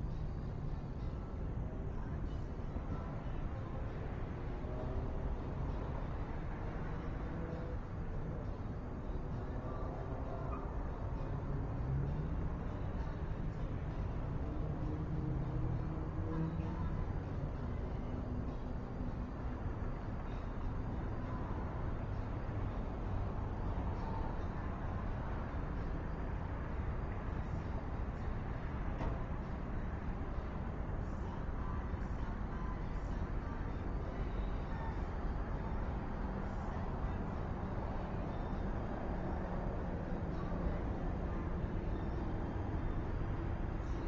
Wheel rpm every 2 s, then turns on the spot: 0, 0, 0, 0, 0, 0, 0, 0, 0, 0, 0, 0, 0, 0, 0, 0, 0, 0, 0, 0, 0, 0.
none